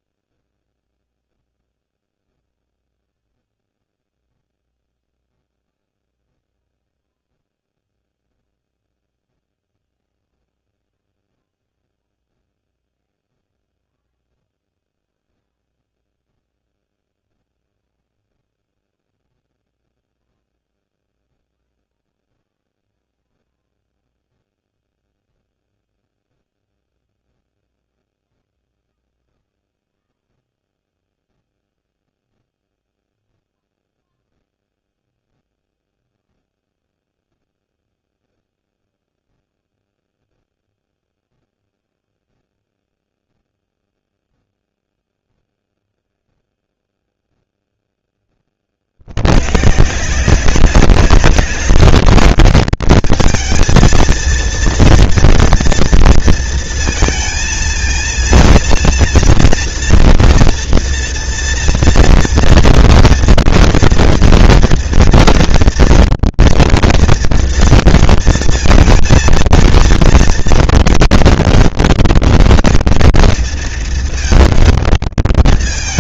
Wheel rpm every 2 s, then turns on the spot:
0, 0, 0, 0, 0, 0, 0, 0, 0, 0, 0, 0, 0, 0, 0, 0, 0, 0, 0, 0, 0, 0, 0, 0, 40, 190, 210, 230, 230, 230, 230, 240, 230, 230, 230, 230, 230, 220.
none